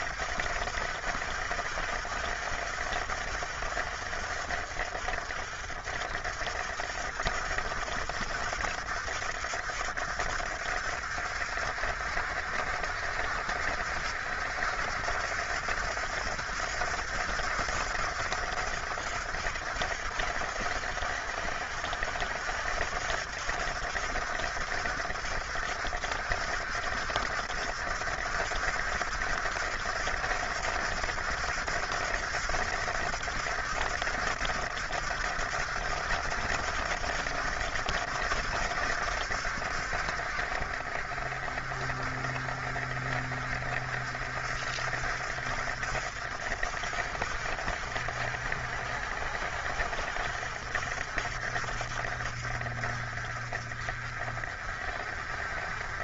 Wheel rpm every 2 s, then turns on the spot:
60, 60, 50, 60, 60, 60, 60, 70, 70, 70, 70, 70, 70, 70, 70, 70, 70, 70, 70, 70, 50, 50, 60, 60, 60, 60, 40, 50.
none